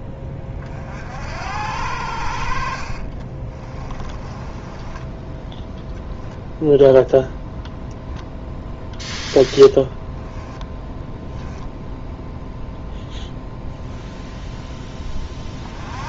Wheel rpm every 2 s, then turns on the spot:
40, 60, 20, 0, 0, 10, 0, 10.
4-6 10-12